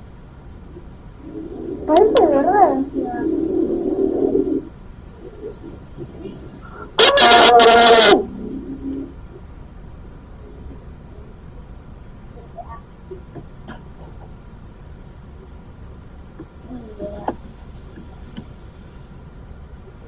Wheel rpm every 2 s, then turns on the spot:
0, 0, 0, 0, 0, 0, 0, 0, 0, 0.
none